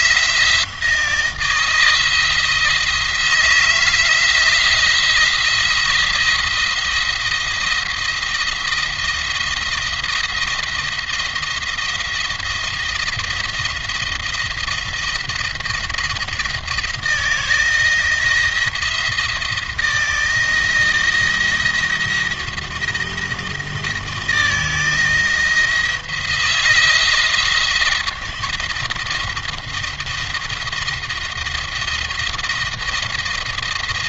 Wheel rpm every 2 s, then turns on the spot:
170, 160, 170, 170, 170, 170, 170, 170, 160, 170, 170, 170, 160, 170, 170, 170, 170.
none